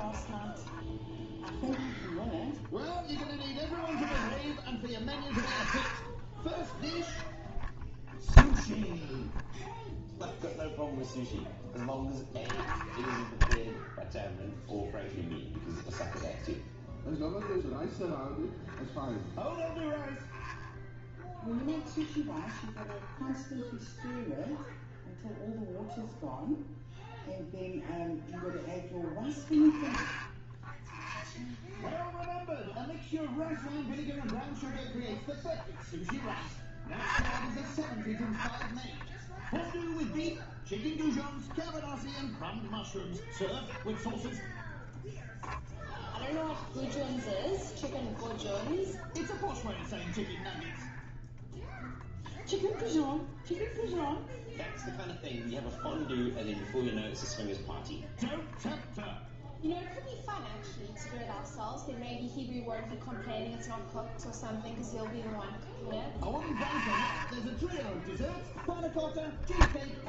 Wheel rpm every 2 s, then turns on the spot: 0, 0, 0, 0, 0, 0, 0, 0, 0, 0, 0, 0, 0, 0, 0, 0, 0, 0, 0, 0, 0, 0, 0, 0, 0, 0, 0, 0, 0, 0, 0, 0, 0, 0, 0.
none